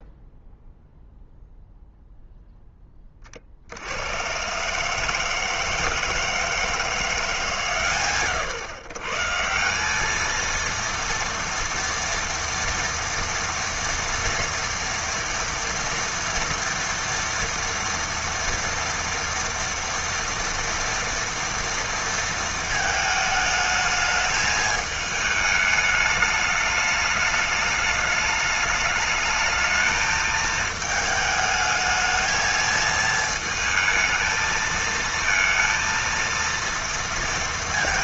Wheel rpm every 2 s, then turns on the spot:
0, 10, 140, 170, 110, 230, 230, 230, 230, 230, 230, 220, 220, 210, 210, 220, 220, 220, 230.
none